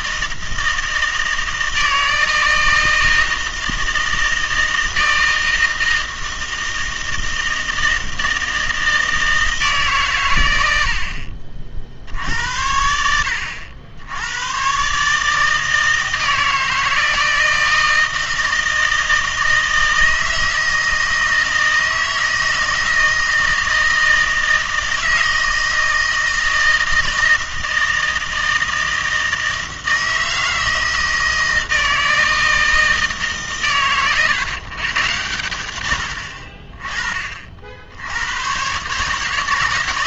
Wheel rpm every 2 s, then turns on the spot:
160, 160, 160, 160, 160, 90, 80, 120, 160, 160, 160, 160, 160, 160, 160, 160, 160, 130, 40, 120.
none